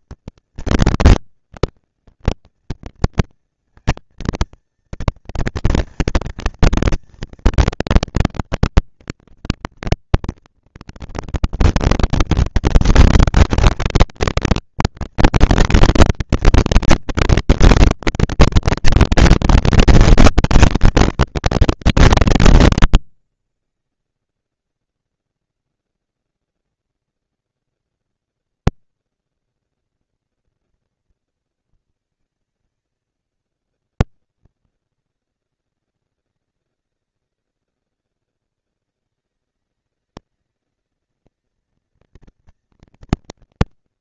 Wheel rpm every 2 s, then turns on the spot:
230, 230, 230, 230, 230, 230, 230, 230, 230, 230, 230, 230, 230, 240, 230, 240, 220, 200, 200, 200, 220, 230.
none